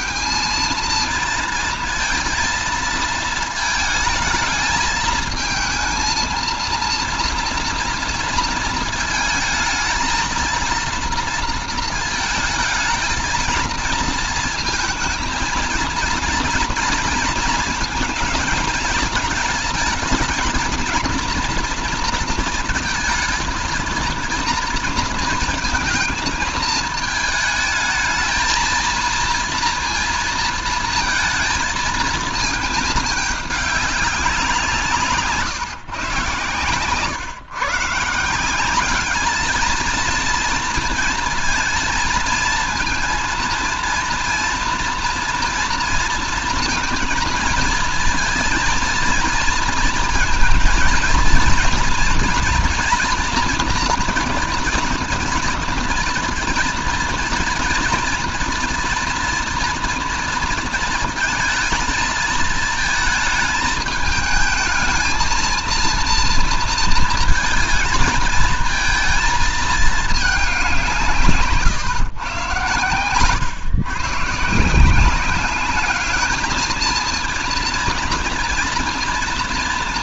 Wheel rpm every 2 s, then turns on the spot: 220, 230, 220, 230, 230, 230, 220, 220, 230, 230, 220, 230, 230, 220, 230, 230, 220, 170, 130, 180, 230, 230, 230, 230, 230, 230, 230, 230, 230, 230, 230, 220, 220, 230, 230, 190, 120, 150, 220, 230.
none